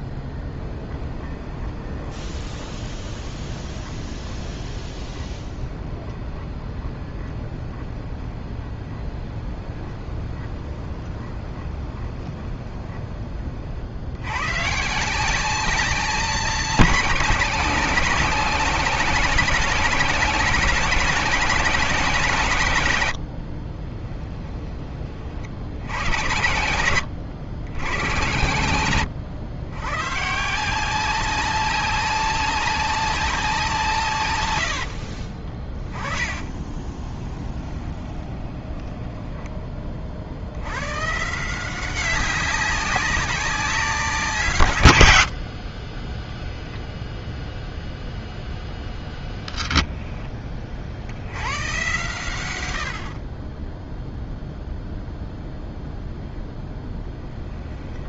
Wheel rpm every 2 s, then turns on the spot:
10, 20, 20, 20, 20, 20, 20, 120, 200, 190, 190, 140, 10, 100, 100, 160, 200, 100, 20, 20, 80, 200, 140, 0, 0, 20, 80, 0, 0.
0-14 28-30 36-40